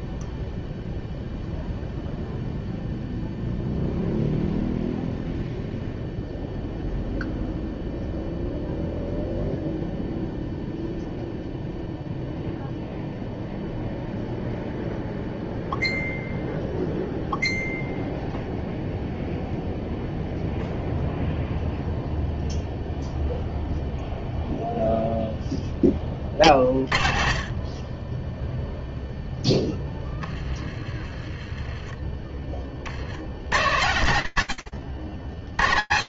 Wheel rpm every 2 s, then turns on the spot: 0, 0, 0, 0, 0, 0, 0, 0, 0, 0, 0, 0, 0, 30, 0, 20, 120, 50.
none